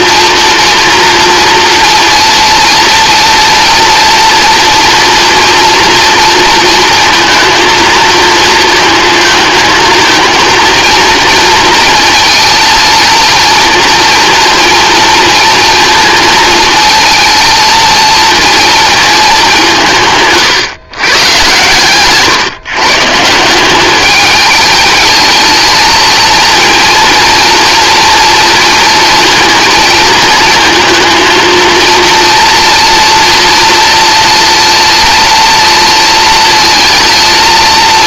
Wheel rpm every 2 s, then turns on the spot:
230, 230, 230, 230, 230, 230, 230, 230, 230, 230, 140, 140, 210, 230, 230, 220, 230, 230, 230.
none